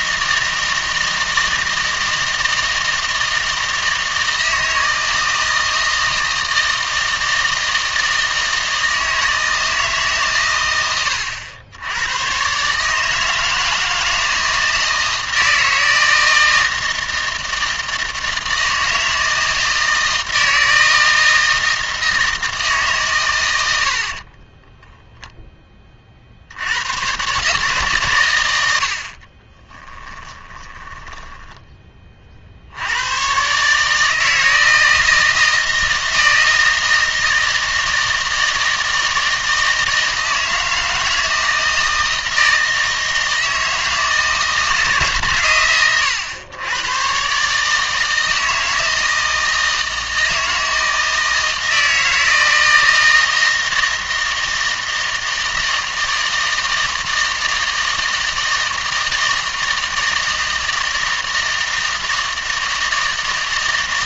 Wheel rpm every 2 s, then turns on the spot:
160, 160, 160, 160, 160, 110, 140, 160, 160, 160, 160, 150, 10, 80, 90, 20, 70, 160, 160, 160, 160, 160, 160, 110, 160, 160, 160, 160, 160, 160, 160, 160.
24-26 30-32